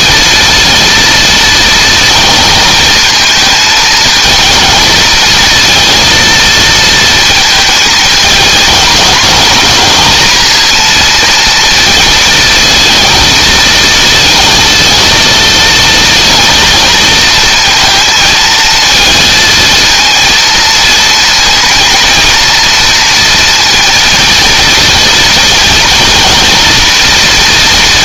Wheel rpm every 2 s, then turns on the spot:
230, 220, 220, 230, 220, 230, 230, 230, 230, 230, 230, 230, 230, 230.
none